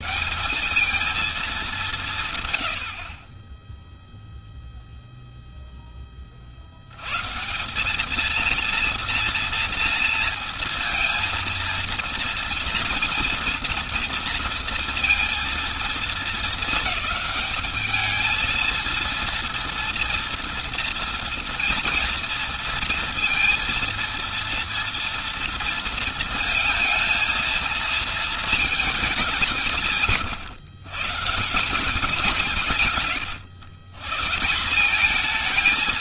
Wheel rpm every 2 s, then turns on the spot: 220, 50, 0, 70, 230, 230, 230, 230, 220, 230, 230, 230, 230, 220, 220, 120, 180, 170.
none